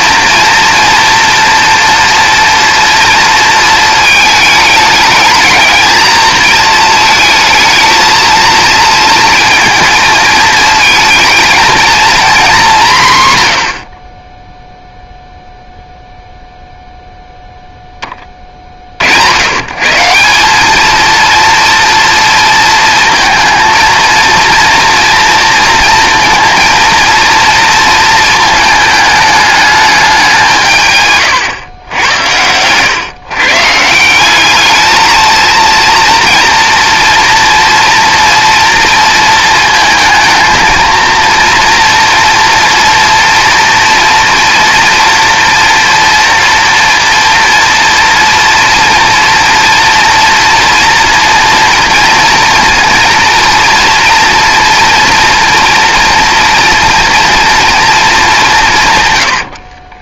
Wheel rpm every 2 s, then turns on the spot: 240, 230, 210, 220, 230, 230, 190, 0, 0, 30, 200, 230, 230, 240, 220, 170, 120, 210, 230, 230, 230, 230, 240, 230, 230, 230, 230, 230, 230, 150.
none